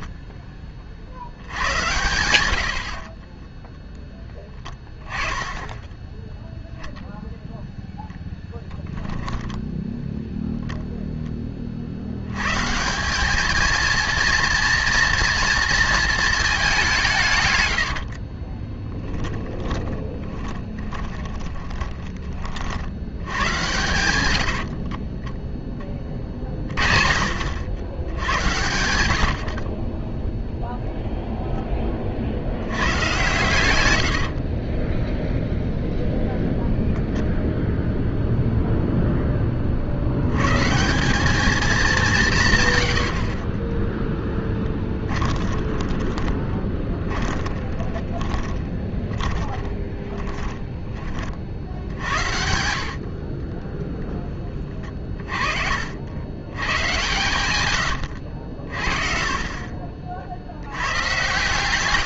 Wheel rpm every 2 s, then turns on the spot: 20, 70, 10, 0, 10, 0, 170, 230, 190, 10, 20, 60, 50, 40, 110, 0, 90, 20, 0, 0, 170, 120, 10, 10, 20, 30, 70, 20, 120, 50, 110.
4-6 8-10 18-22 24-26 28-30 32-36 44-52